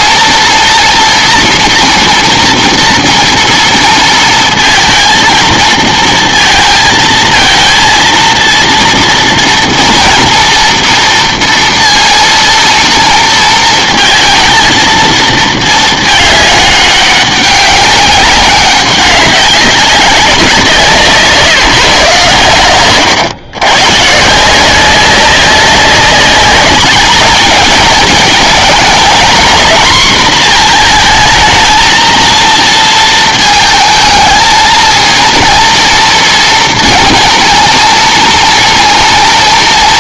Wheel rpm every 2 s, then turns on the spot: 230, 230, 220, 230, 230, 230, 230, 230, 210, 200, 170, 110, 170, 200, 220, 240, 230, 230, 230, 230.
none